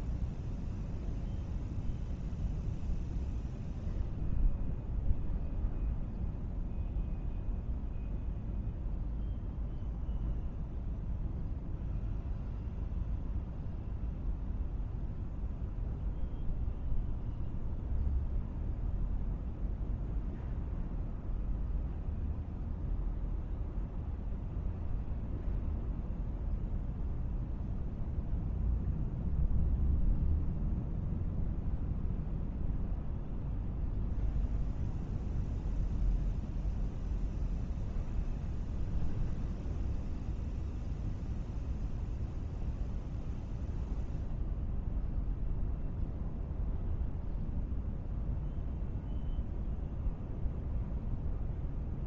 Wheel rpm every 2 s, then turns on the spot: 0, 0, 0, 0, 0, 0, 0, 0, 0, 0, 0, 0, 0, 0, 0, 0, 0, 0, 0, 0, 0, 0, 0, 0, 0, 0.
none